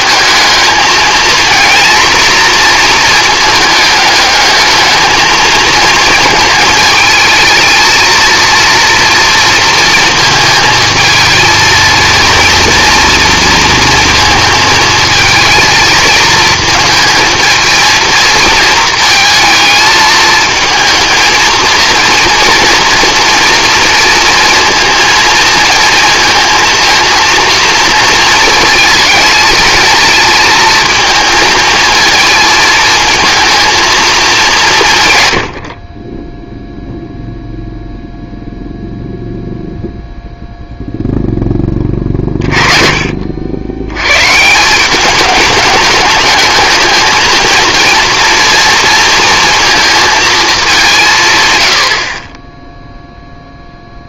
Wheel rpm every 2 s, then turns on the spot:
220, 240, 210, 220, 230, 220, 240, 230, 220, 220, 220, 230, 230, 230, 220, 230, 220, 190, 0, 0, 0, 30, 170, 220, 230, 210, 20.
none